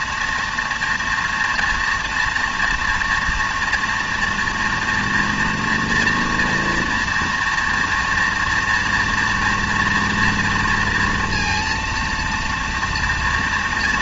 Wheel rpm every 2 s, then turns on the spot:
230, 230, 230, 230, 230, 240, 240.
none